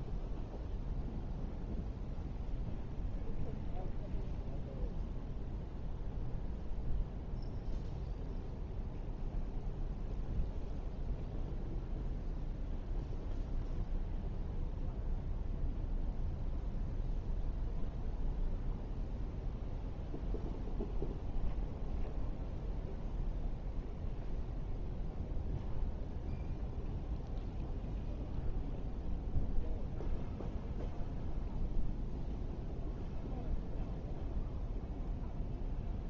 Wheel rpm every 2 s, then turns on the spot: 0, 0, 0, 0, 0, 0, 0, 0, 0, 0, 0, 0, 0, 0, 0, 0, 0, 0.
none